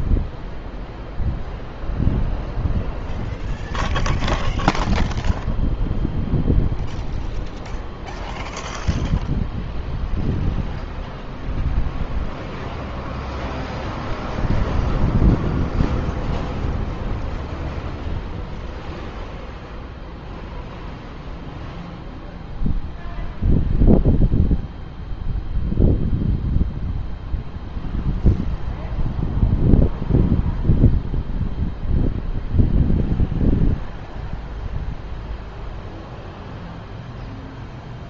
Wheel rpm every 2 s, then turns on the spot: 0, 0, 0, 0, 0, 0, 0, 0, 0, 0, 0, 0, 0, 0, 0, 0, 0, 0, 0.
none